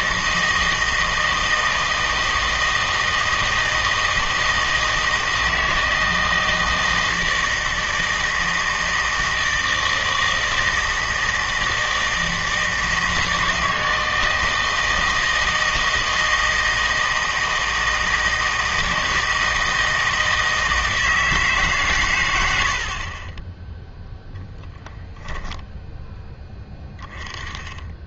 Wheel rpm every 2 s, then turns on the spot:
160, 160, 160, 160, 160, 160, 160, 160, 160, 160, 160, 90, 10, 10.
none